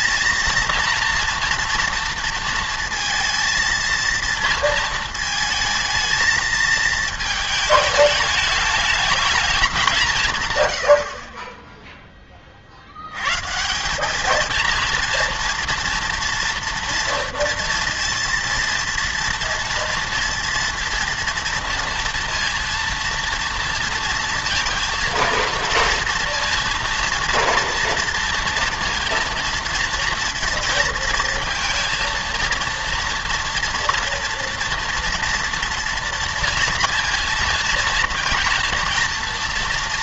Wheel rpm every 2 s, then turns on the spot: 230, 230, 230, 220, 210, 100, 60, 230, 230, 230, 230, 230, 230, 230, 230, 230, 230, 230, 230, 230.
none